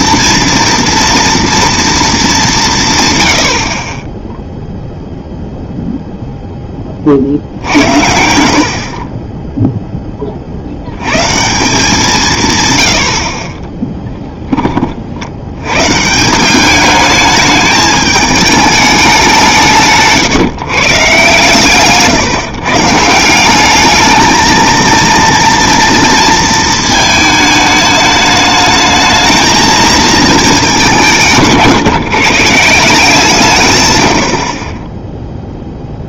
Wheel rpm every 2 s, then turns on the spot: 230, 220, 10, 0, 60, 70, 110, 30, 200, 210, 140, 150, 230, 230, 220, 210, 170, 20.
8-10